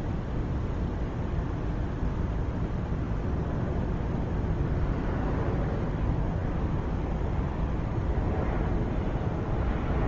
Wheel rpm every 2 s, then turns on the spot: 0, 0, 0, 0, 0.
none